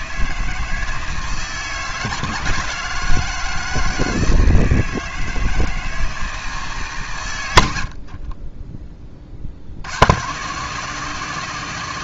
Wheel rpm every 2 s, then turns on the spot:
160, 160, 160, 140, 20, 150.
none